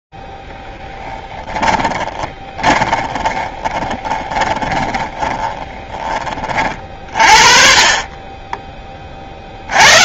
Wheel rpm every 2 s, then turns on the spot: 0, 20, 20, 20, 40.
2-6